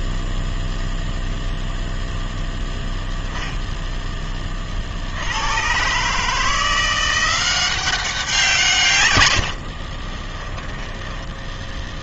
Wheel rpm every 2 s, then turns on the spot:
0, 0, 50, 170, 140, 10.
10-12